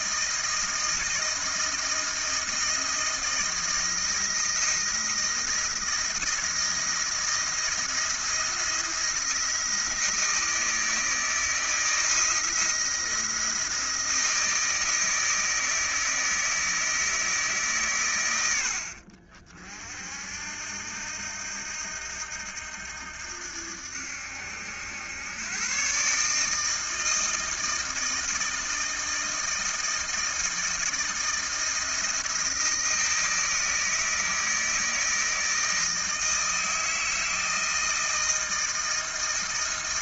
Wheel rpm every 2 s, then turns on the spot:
160, 160, 160, 170, 170, 160, 160, 160, 160, 60, 80, 80, 100, 160, 160, 160, 160, 160, 160, 160.
none